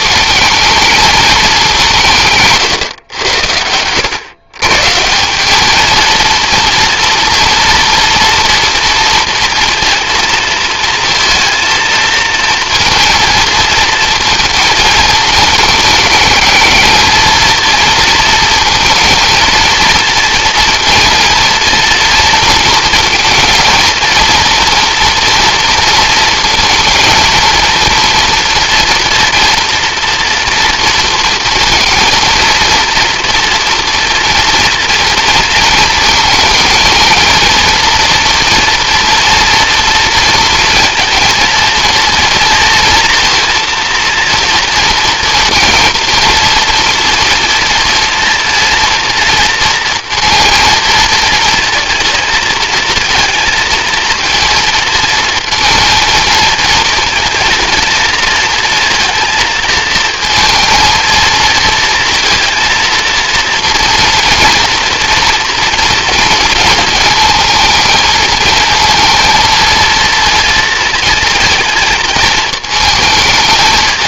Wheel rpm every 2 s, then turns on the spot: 220, 150, 120, 230, 230, 230, 230, 220, 220, 230, 230, 230, 230, 230, 240, 230, 230, 230, 220, 230, 230, 230, 230, 230, 230, 230, 230, 230, 230, 230, 230, 230, 240, 230, 230, 230, 220.
none